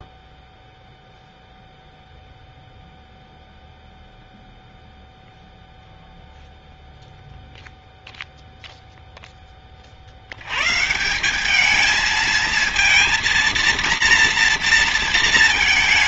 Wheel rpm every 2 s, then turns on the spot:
0, 0, 0, 0, 0, 110, 220, 230.
none